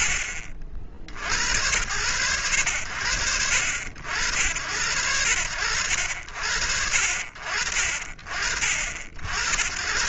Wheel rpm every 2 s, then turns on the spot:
50, 60, 90, 50, 70.
none